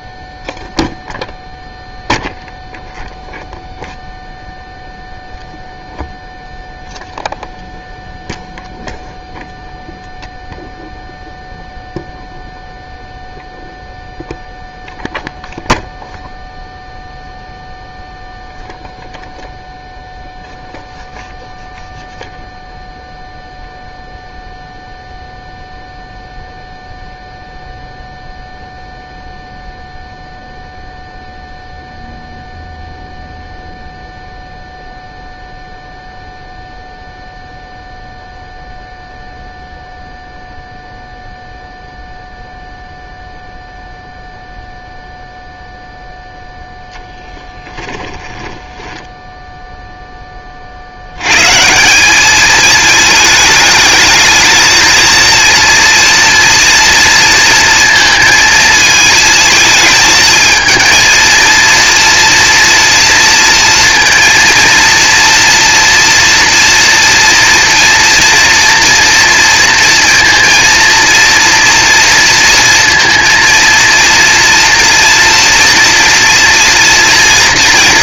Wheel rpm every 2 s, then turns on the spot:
0, 0, 0, 0, 0, 0, 0, 0, 0, 0, 0, 0, 0, 0, 0, 0, 0, 0, 0, 0, 0, 0, 0, 10, 10, 70, 220, 230, 240, 220, 220, 230, 230, 240, 240, 230, 230, 230, 230.
48-50